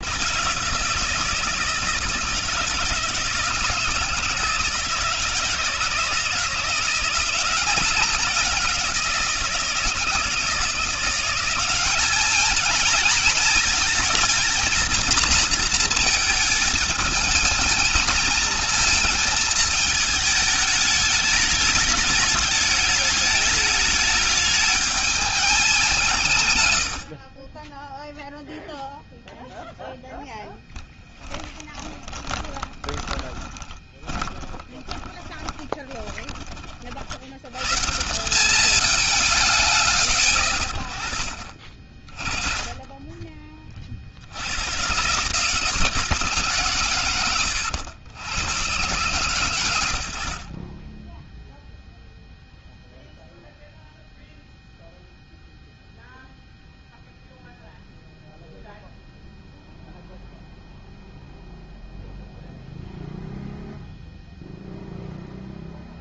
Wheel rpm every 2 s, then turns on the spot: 160, 160, 160, 180, 170, 180, 220, 230, 220, 230, 210, 210, 210, 50, 0, 10, 20, 20, 80, 190, 40, 20, 130, 110, 120, 10, 0, 0, 0, 0, 0, 0, 0.
30-36